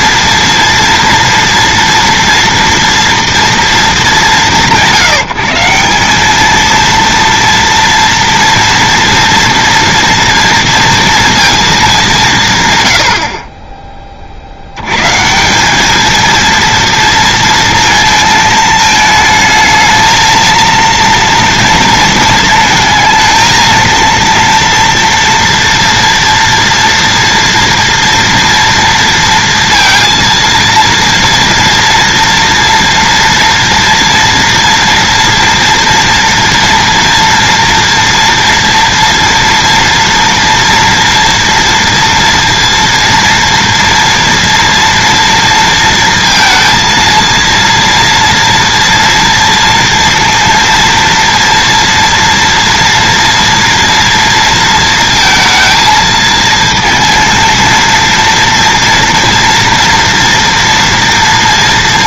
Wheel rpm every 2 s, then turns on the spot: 230, 230, 180, 210, 230, 230, 130, 80, 230, 220, 230, 230, 230, 230, 230, 230, 230, 230, 240, 230, 230, 230, 230, 230, 230, 230, 230, 230, 230, 230, 230.
none